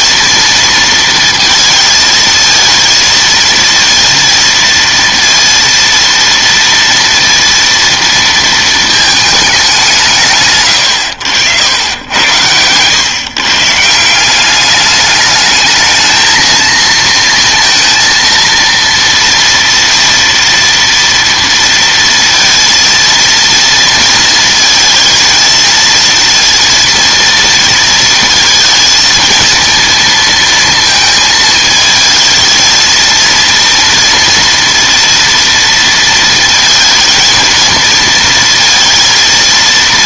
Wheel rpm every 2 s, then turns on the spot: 230, 230, 230, 230, 230, 120, 100, 200, 220, 230, 230, 230, 230, 230, 230, 230, 220, 240, 230, 230.
12-14